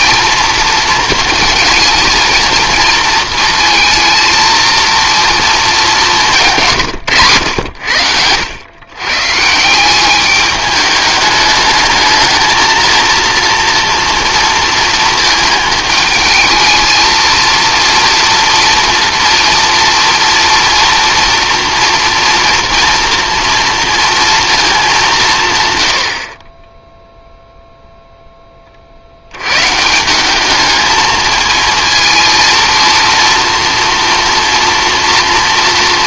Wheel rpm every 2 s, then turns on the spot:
230, 230, 230, 150, 110, 210, 220, 230, 220, 230, 230, 230, 220, 10, 30, 210, 230, 230.
none